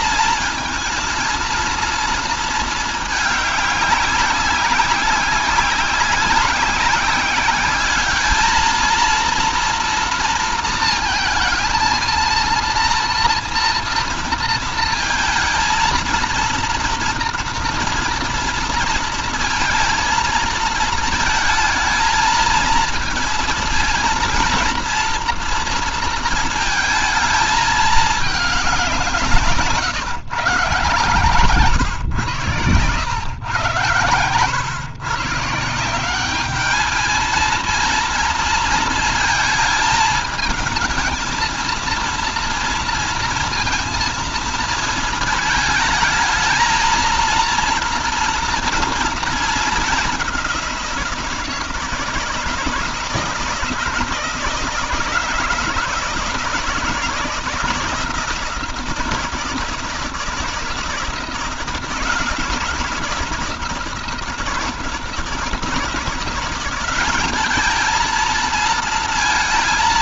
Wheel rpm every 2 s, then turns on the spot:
230, 220, 190, 190, 220, 230, 230, 230, 230, 230, 230, 230, 230, 230, 210, 140, 110, 110, 210, 230, 220, 230, 230, 220, 240, 190, 170, 170, 160, 170, 160, 160, 160, 180, 230.
none